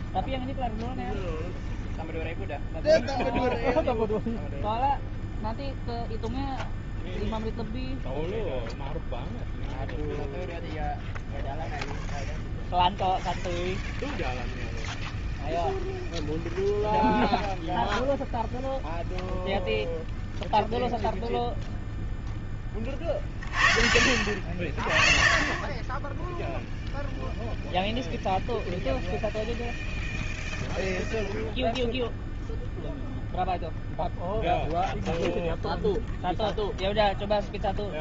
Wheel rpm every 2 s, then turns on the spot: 0, 0, 0, 0, 0, 0, 0, 0, 0, 0, 0, 20, 50, 0, 0, 0, 0, 0, 0.
none